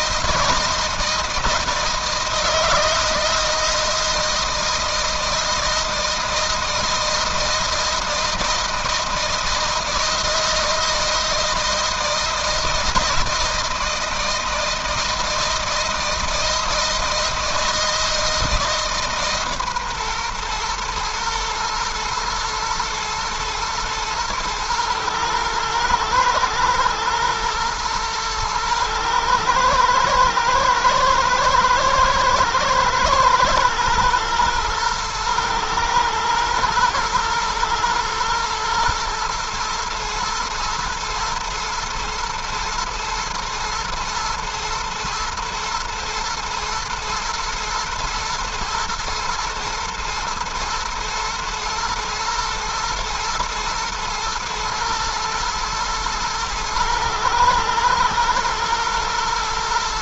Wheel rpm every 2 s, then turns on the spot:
160, 160, 160, 160, 160, 160, 160, 160, 160, 150, 120, 120, 110, 120, 110, 110, 110, 120, 110, 120, 110, 110, 110, 120, 120, 120, 120, 120, 110, 120.
none